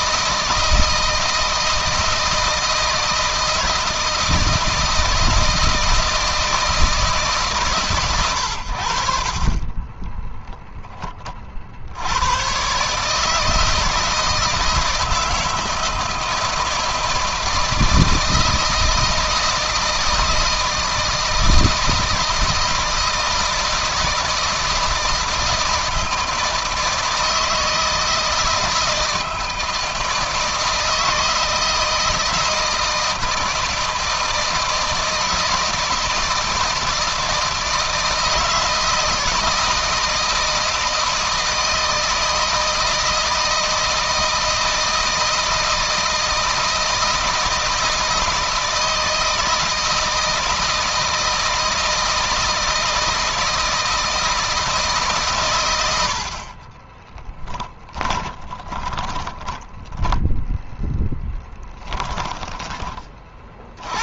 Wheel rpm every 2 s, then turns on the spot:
160, 160, 160, 160, 80, 10, 130, 160, 160, 160, 160, 160, 160, 160, 160, 160, 160, 160, 160, 160, 160, 160, 160, 160, 160, 160, 160, 160, 30, 20, 0, 20.
56-60